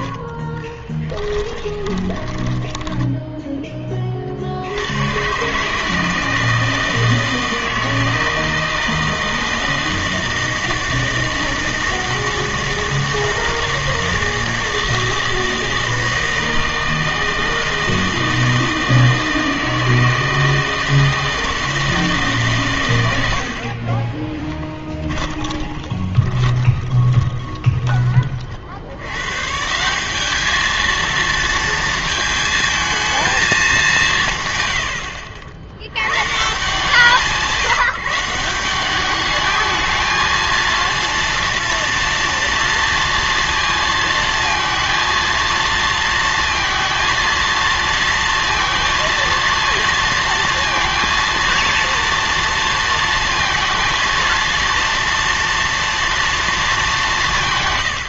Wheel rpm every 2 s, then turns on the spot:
20, 10, 70, 160, 160, 160, 160, 160, 160, 160, 160, 130, 20, 20, 70, 220, 220, 120, 150, 180, 230, 230, 230, 230, 230, 230, 230, 230, 220.
0-4 24-28